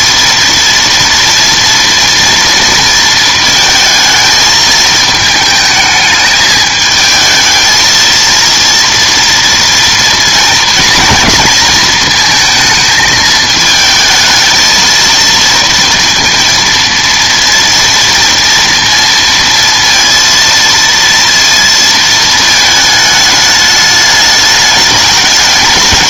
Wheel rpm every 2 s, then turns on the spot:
230, 230, 220, 220, 230, 230, 220, 220, 230, 230, 230, 220, 210.
none